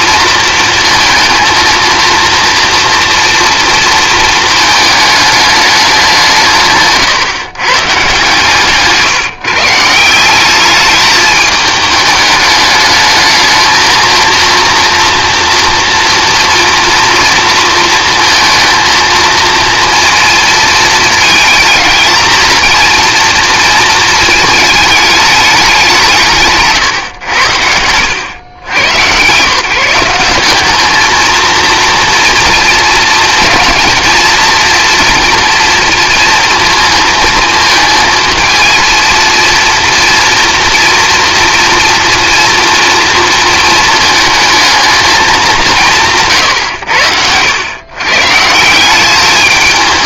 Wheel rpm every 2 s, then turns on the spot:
230, 230, 220, 160, 150, 210, 210, 230, 230, 230, 220, 230, 210, 130, 110, 210, 230, 230, 230, 230, 230, 230, 220, 100, 170.
26-28